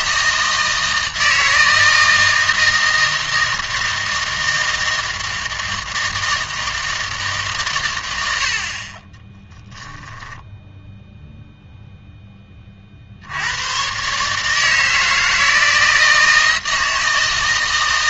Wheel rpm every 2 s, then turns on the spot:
160, 160, 160, 160, 60, 10, 30, 150, 160.
none